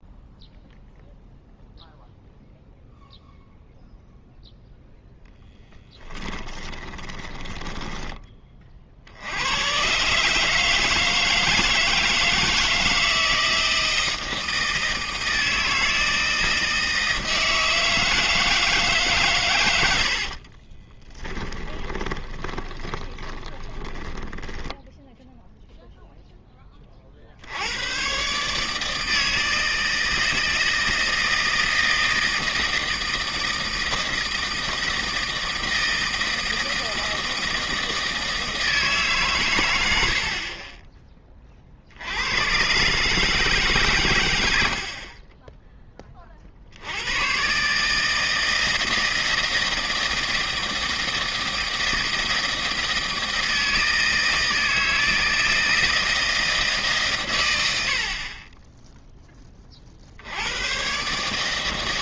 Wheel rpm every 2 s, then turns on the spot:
0, 0, 0, 20, 30, 150, 160, 160, 160, 160, 40, 20, 10, 10, 150, 160, 160, 160, 160, 160, 40, 110, 80, 50, 160, 160, 160, 160, 160, 30, 100.
6-8 20-26